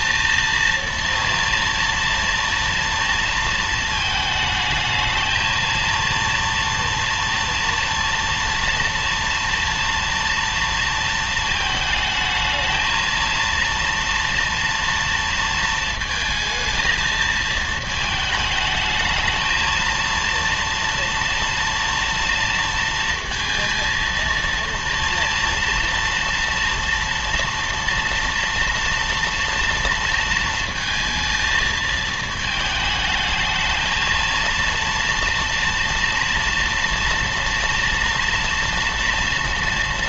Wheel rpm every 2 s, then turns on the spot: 230, 230, 220, 230, 230, 230, 220, 230, 220, 220, 230, 230, 230, 230, 230, 230, 220, 230, 230, 230.
none